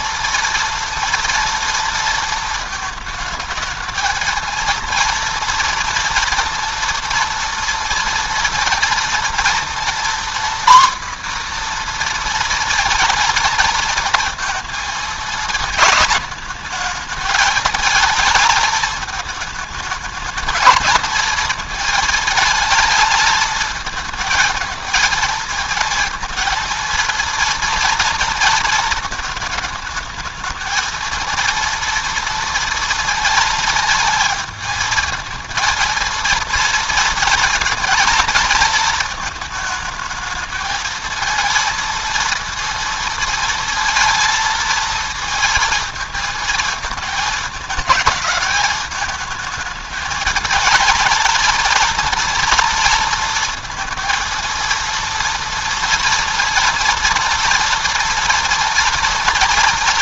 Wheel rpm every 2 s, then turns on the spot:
230, 220, 230, 230, 230, 250, 230, 220, 220, 220, 220, 220, 220, 230, 220, 220, 230, 220, 230, 230, 220, 230, 230, 220, 220, 230, 230, 230, 230, 230.
none